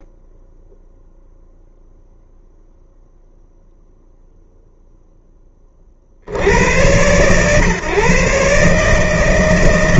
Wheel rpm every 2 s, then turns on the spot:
0, 0, 0, 80, 140.
none